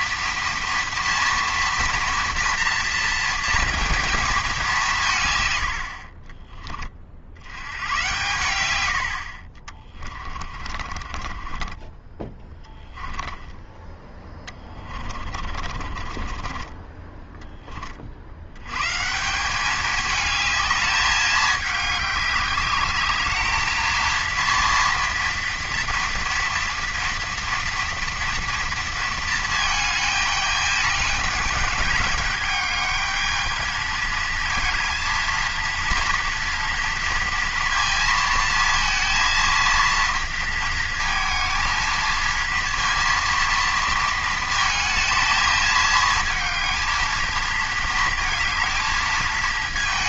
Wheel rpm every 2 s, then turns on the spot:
230, 230, 180, 20, 90, 40, 10, 30, 20, 120, 210, 200, 230, 230, 230, 210, 210, 230, 230, 230, 230, 230, 220, 220, 230.
8-18